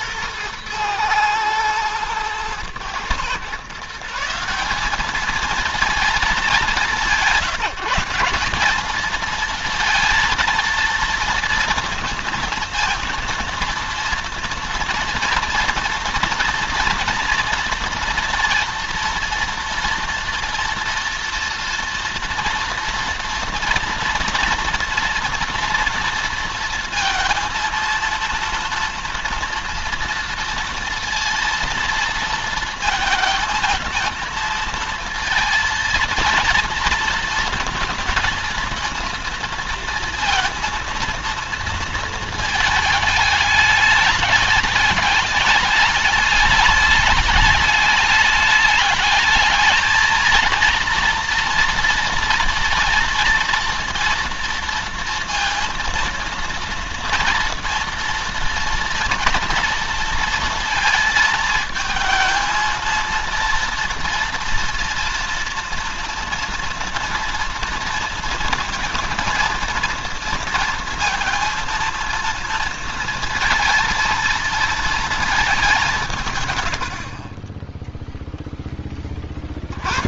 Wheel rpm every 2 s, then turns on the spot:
110, 110, 190, 180, 190, 230, 230, 230, 230, 230, 240, 240, 230, 230, 230, 230, 230, 230, 230, 230, 230, 220, 210, 210, 210, 230, 230, 230, 230, 240, 230, 230, 230, 230, 230, 230, 230, 230, 110, 20.
none